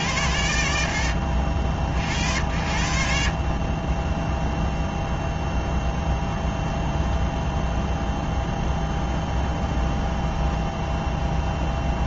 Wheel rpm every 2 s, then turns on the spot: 20, 0, 0, 10, 0, 10.
6-8